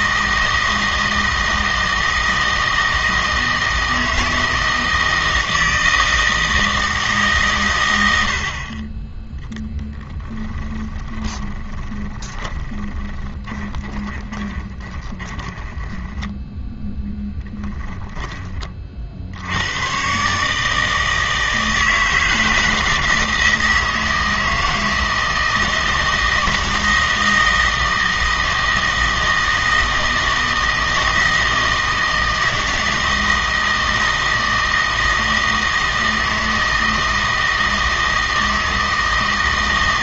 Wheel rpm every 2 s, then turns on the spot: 160, 160, 160, 160, 30, 20, 20, 20, 10, 30, 150, 160, 160, 160, 160, 160, 160, 160, 160, 160.
10-16